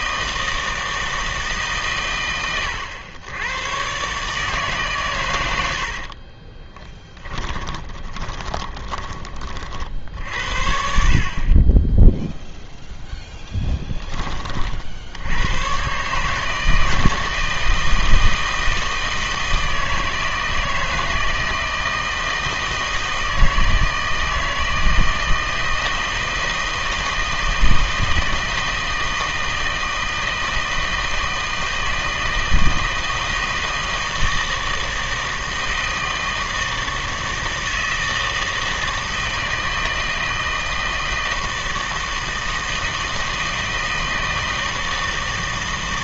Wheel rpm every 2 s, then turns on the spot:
160, 110, 150, 20, 20, 60, 0, 40, 160, 160, 160, 160, 160, 160, 160, 160, 160, 160, 160, 160, 160, 160, 160.
6-10